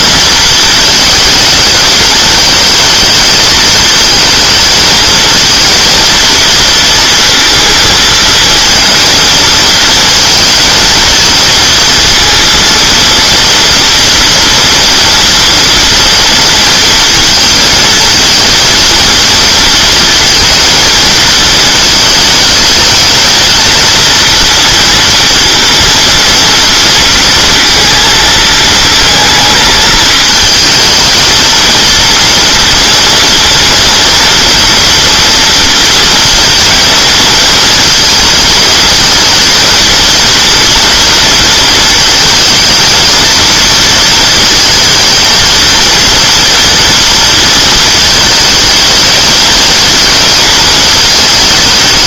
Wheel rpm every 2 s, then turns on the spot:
230, 220, 220, 230, 230, 230, 230, 230, 230, 230, 230, 220, 240, 230, 220, 220, 230, 230, 230, 220, 230, 230, 230, 230, 220, 220.
none